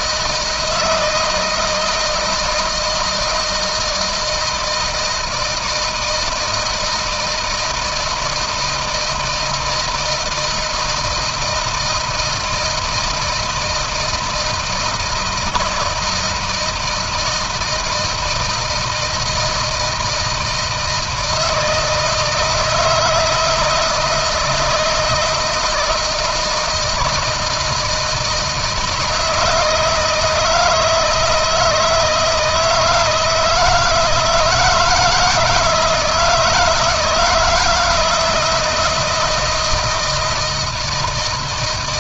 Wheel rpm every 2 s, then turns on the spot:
160, 160, 160, 160, 160, 160, 160, 160, 160, 160, 160, 160, 160, 160, 160, 160, 160, 160, 160, 170, 170.
none